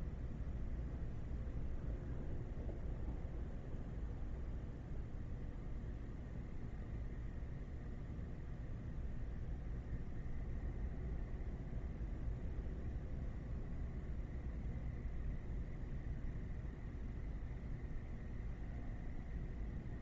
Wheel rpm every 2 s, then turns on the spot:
0, 0, 0, 0, 0, 0, 0, 0, 0, 0.
none